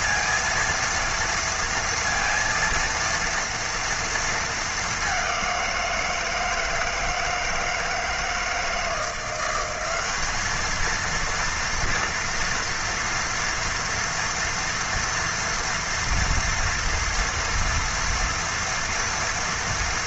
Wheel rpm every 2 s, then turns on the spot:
230, 230, 210, 160, 160, 220, 230, 230, 230, 230.
none